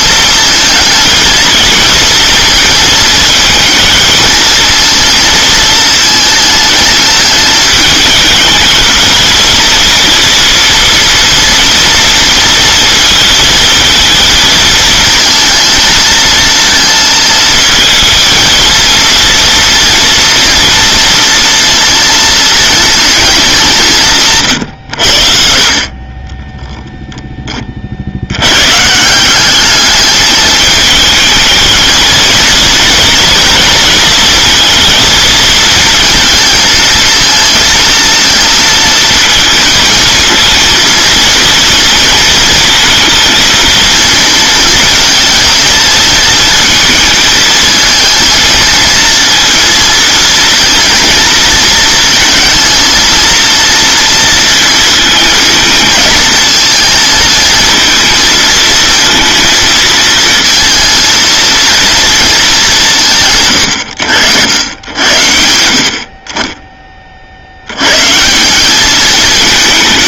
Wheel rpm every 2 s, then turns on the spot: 220, 220, 220, 220, 220, 230, 230, 230, 230, 230, 230, 230, 90, 10, 140, 220, 230, 230, 220, 230, 230, 220, 230, 220, 220, 230, 230, 220, 230, 230, 230, 170, 90, 30, 200.
none